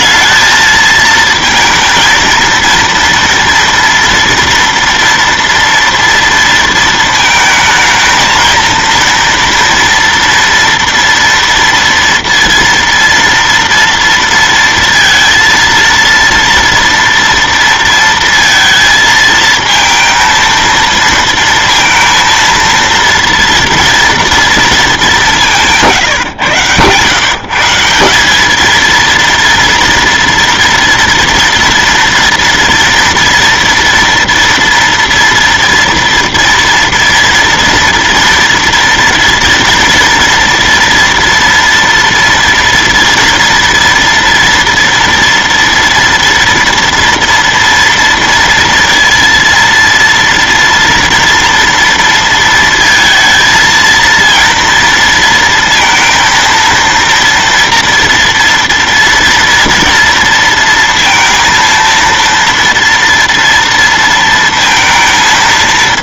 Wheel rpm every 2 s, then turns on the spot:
220, 230, 230, 230, 230, 230, 230, 230, 230, 230, 230, 230, 220, 110, 220, 230, 230, 240, 230, 230, 230, 230, 230, 230, 230, 230, 230, 230, 230, 230, 230, 230, 230.
none